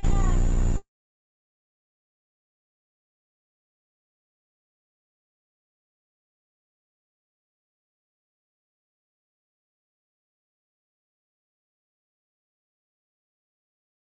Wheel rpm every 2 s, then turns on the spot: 40, 30, 100, 50, 20, 110, 20.
0-2 8-10 12-14